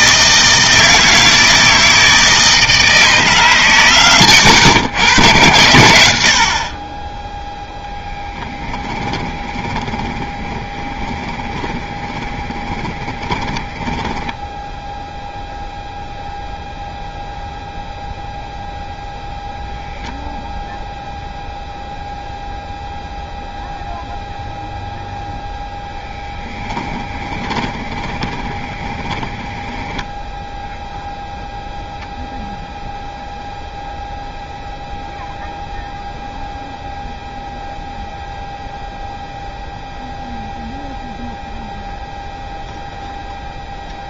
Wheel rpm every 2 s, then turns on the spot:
160, 160, 110, 30, 20, 20, 10, 0, 0, 0, 0, 0, 0, 10, 20, 0, 0, 0, 0, 0, 0, 0.
8-14 26-30